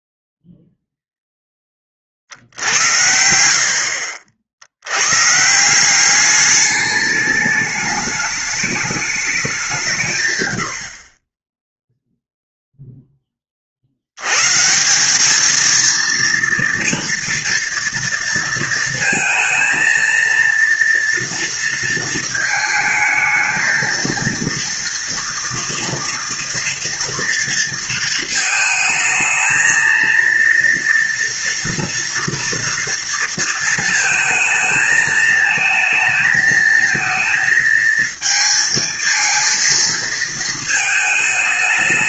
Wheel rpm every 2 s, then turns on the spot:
0, 60, 70, 200, 210, 100, 0, 150, 230, 230, 230, 220, 240, 230, 220, 230, 230, 220, 220, 220, 220.
2-4